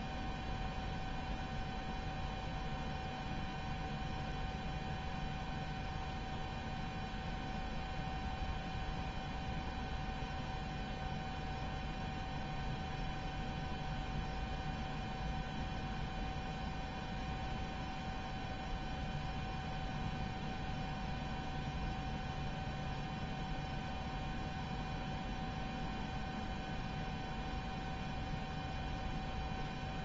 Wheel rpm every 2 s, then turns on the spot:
0, 0, 0, 0, 0, 0, 0, 0, 0, 0, 0, 0, 0, 0, 0.
none